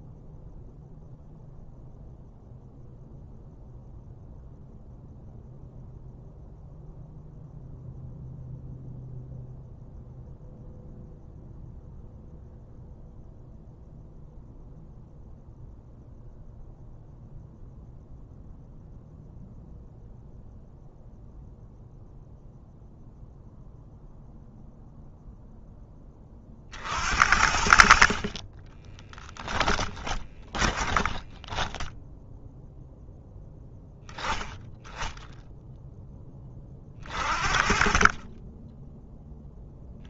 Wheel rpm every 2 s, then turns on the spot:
0, 0, 0, 0, 0, 0, 0, 0, 0, 0, 0, 0, 10, 50, 20, 0, 10, 10, 30, 10.
28-30